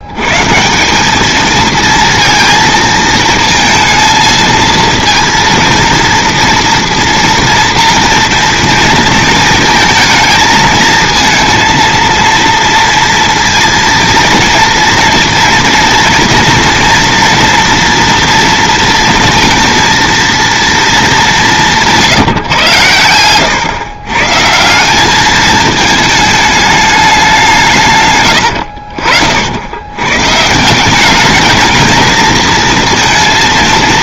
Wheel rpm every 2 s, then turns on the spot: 150, 230, 230, 230, 230, 220, 230, 230, 230, 230, 230, 130, 160, 210, 80, 150, 230.
none